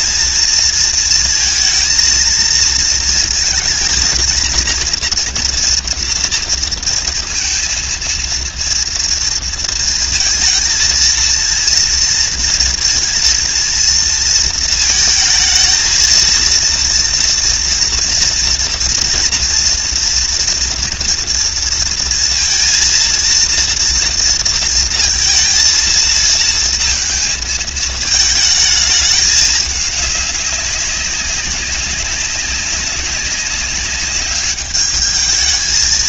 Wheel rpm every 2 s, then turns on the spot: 230, 230, 240, 230, 230, 230, 230, 220, 230, 230, 240, 230, 230, 230, 210, 190, 200, 210.
none